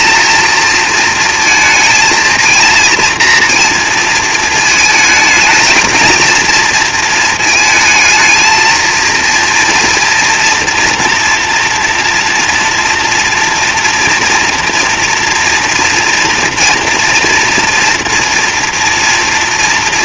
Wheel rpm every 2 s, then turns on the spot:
230, 230, 220, 230, 230, 230, 230, 230, 230, 240.
none